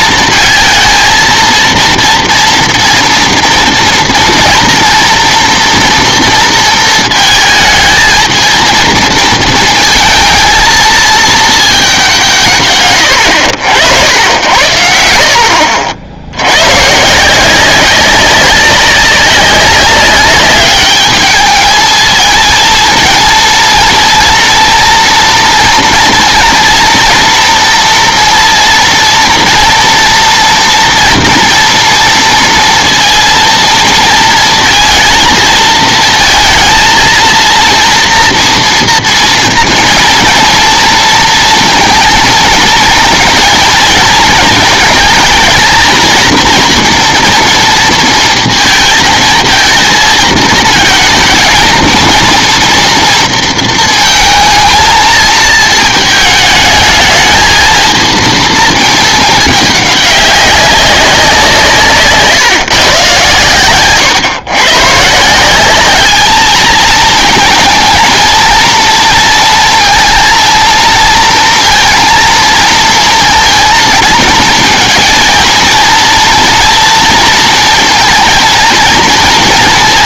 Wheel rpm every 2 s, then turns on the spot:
230, 230, 230, 220, 230, 220, 130, 70, 100, 200, 200, 220, 230, 230, 230, 230, 230, 230, 220, 230, 230, 230, 220, 230, 230, 220, 230, 230, 220, 220, 200, 150, 120, 220, 230, 230, 230, 230, 240, 230.
none